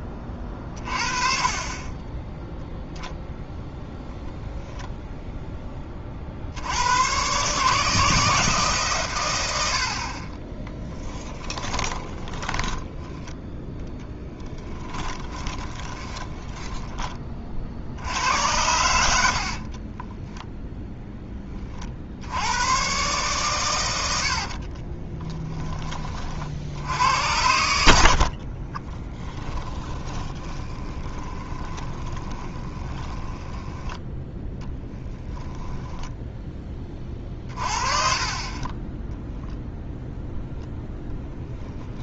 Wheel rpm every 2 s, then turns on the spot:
30, 0, 0, 80, 150, 20, 10, 10, 10, 90, 0, 110, 40, 70, 30, 20, 20, 10, 20, 20, 0.
10-18 24-26 28-34 38-40